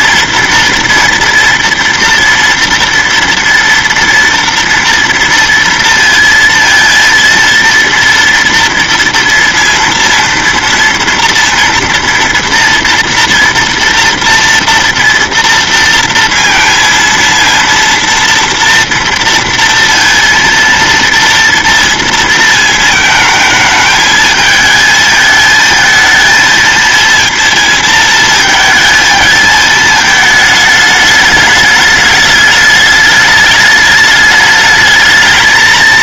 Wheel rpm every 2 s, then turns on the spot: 230, 230, 230, 230, 230, 230, 230, 230, 230, 230, 230, 220, 220, 230, 220, 210, 210, 210.
none